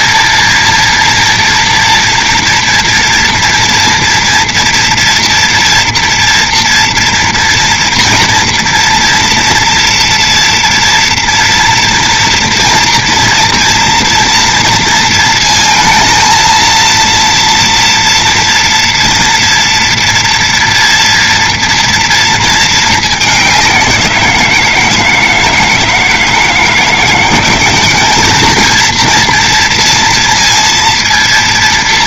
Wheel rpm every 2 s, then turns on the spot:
230, 230, 230, 230, 230, 230, 230, 230, 230, 230, 240, 220, 170, 160, 220, 230.
none